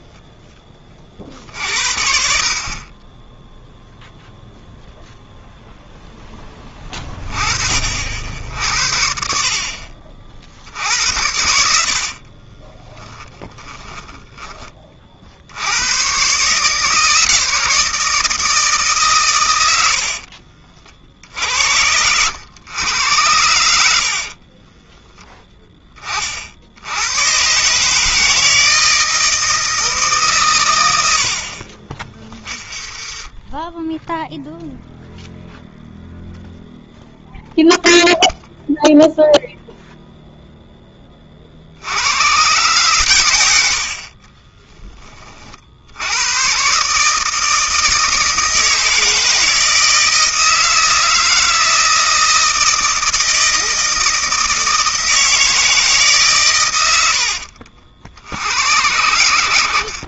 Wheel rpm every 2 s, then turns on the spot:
10, 50, 0, 10, 60, 60, 40, 20, 130, 160, 40, 100, 30, 60, 160, 130, 20, 0, 0, 0, 0, 120, 20, 120, 160, 160, 160, 160, 130, 80.
12-16 20-22 24-26 32-34 44-46